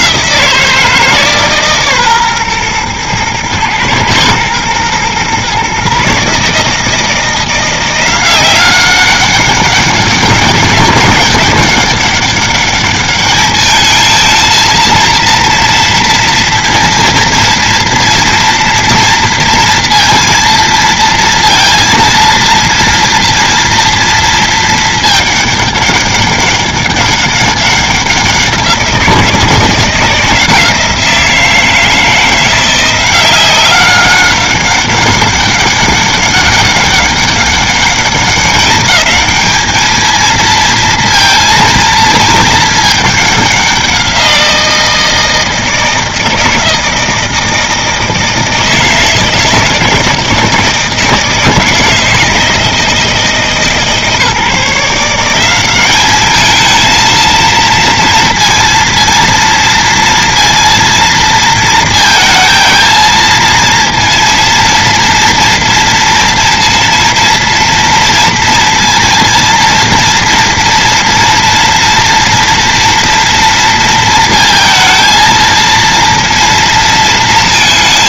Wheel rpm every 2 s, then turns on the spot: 160, 120, 120, 160, 190, 190, 200, 230, 230, 230, 230, 230, 220, 200, 180, 170, 180, 200, 200, 190, 230, 210, 170, 160, 160, 160, 160, 160, 220, 230, 230, 230, 230, 230, 230, 230, 230, 230, 230.
none